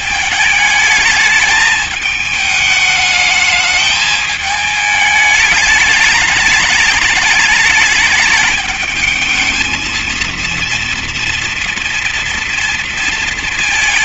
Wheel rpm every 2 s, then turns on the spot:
220, 220, 210, 210, 220, 230, 230.
none